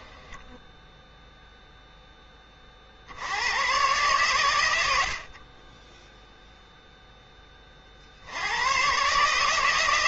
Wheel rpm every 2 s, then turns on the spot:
10, 30, 110, 0, 100.
none